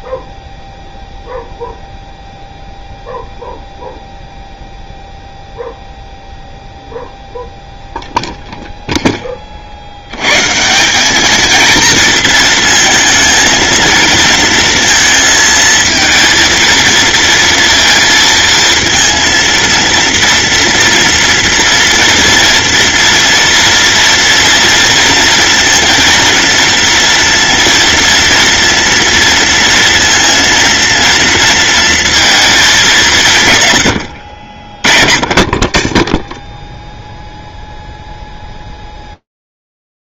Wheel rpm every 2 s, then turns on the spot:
0, 0, 0, 0, 0, 180, 230, 230, 230, 230, 230, 230, 230, 230, 230, 230, 200, 40, 0, 0.
none